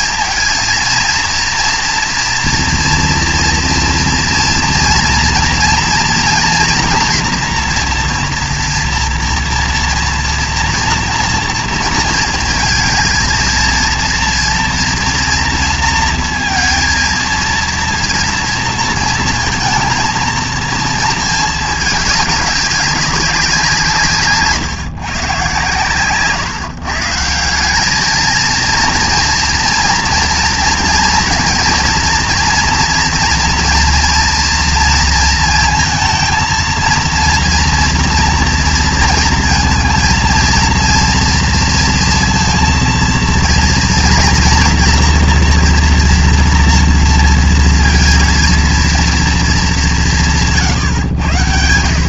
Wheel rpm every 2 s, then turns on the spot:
230, 230, 230, 230, 230, 240, 230, 230, 230, 230, 230, 200, 130, 150, 230, 230, 240, 230, 230, 230, 230, 230, 240, 230, 230, 140.
none